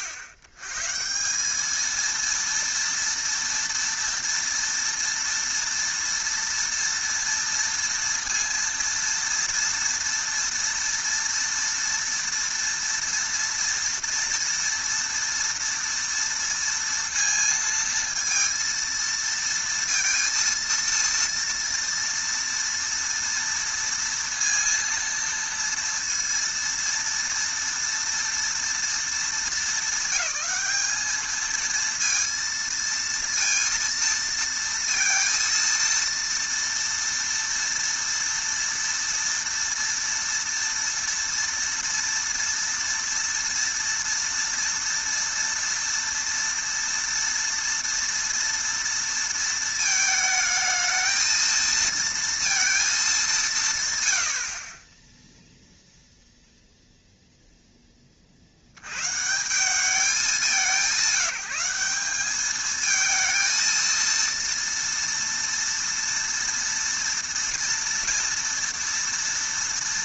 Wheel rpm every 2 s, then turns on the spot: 120, 230, 230, 230, 230, 230, 230, 230, 230, 230, 230, 230, 230, 230, 230, 210, 230, 230, 230, 230, 230, 240, 230, 230, 230, 220, 230, 50, 0, 80, 180, 210, 230, 230, 230.
none